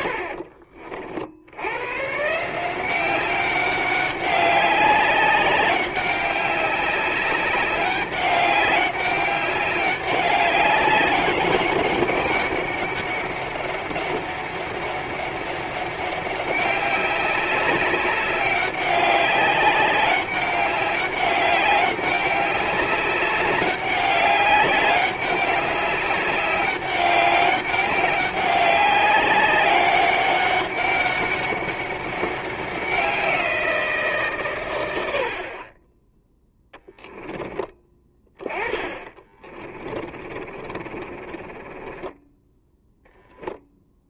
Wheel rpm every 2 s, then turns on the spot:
40, 180, 190, 200, 200, 200, 200, 200, 190, 190, 200, 200, 200, 200, 200, 200, 190, 110, 10, 20, 30, 0.
36-42